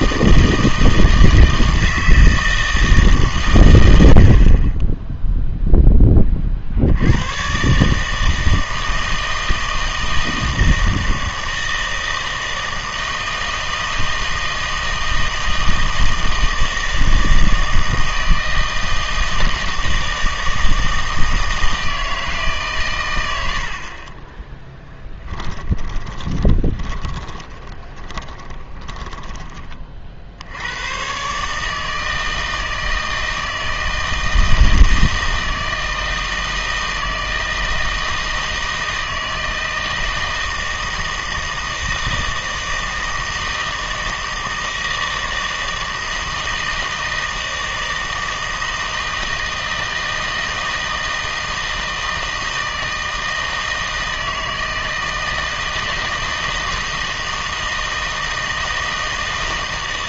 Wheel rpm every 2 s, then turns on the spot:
160, 160, 30, 60, 160, 160, 160, 160, 160, 160, 160, 130, 10, 20, 20, 80, 160, 160, 160, 160, 160, 160, 160, 160, 160, 160, 160, 160, 160, 160.
24-30